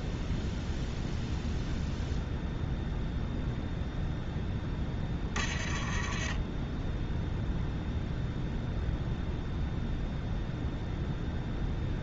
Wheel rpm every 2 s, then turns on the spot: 0, 0, 10, 10, 0, 0.
none